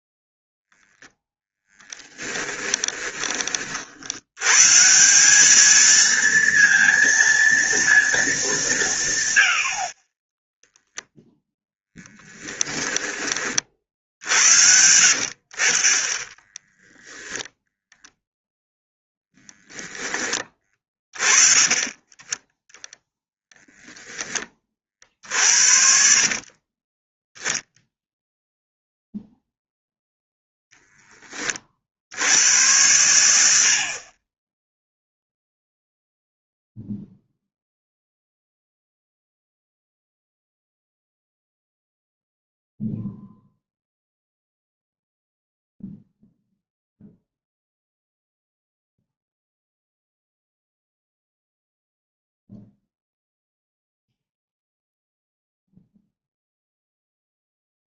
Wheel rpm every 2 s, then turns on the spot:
0, 20, 140, 230, 180, 0, 10, 70, 10, 10, 20, 10, 30, 20, 0, 0, 90, 0, 0, 0, 0, 0, 0, 0, 0, 0, 0, 0, 0.
2-4 12-14 16-18 20-22 26-28